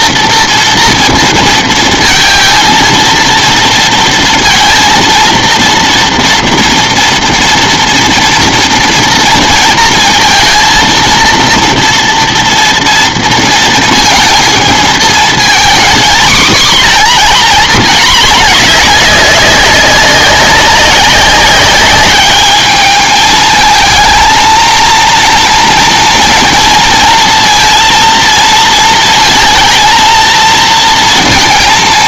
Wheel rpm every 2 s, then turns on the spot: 230, 230, 230, 230, 230, 230, 230, 220, 250, 210, 190, 210, 230, 230, 230, 230.
none